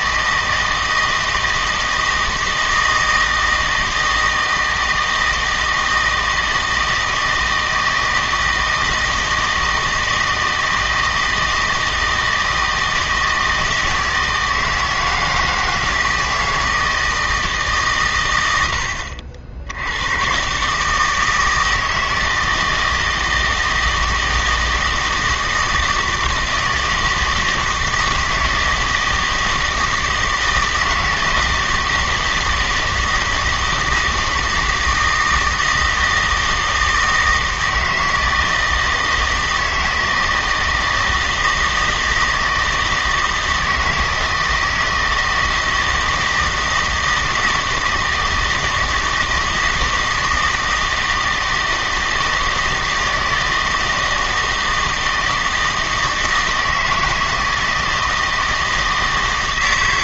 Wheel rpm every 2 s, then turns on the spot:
160, 160, 160, 160, 160, 160, 160, 160, 160, 90, 140, 160, 160, 160, 160, 160, 160, 160, 160, 160, 160, 160, 160, 160, 160, 160, 160, 160, 160, 160.
none